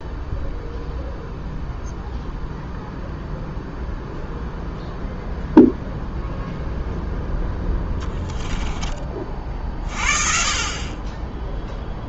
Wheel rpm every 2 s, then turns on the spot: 0, 0, 0, 0, 20, 30.
none